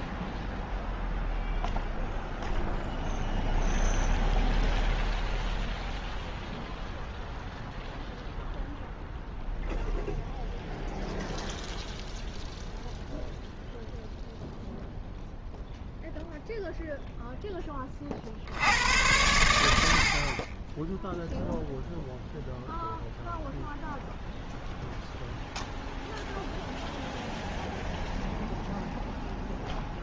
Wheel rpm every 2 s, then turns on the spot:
0, 0, 0, 0, 0, 0, 0, 0, 0, 90, 20, 0, 0, 0, 0.
none